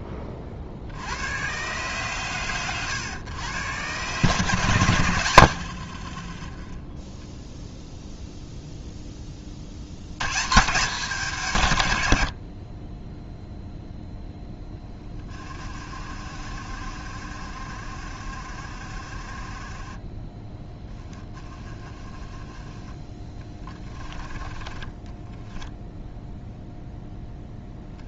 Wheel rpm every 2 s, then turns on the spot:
20, 130, 140, 10, 0, 170, 30, 10, 50, 40, 10, 10, 10, 0.
24-26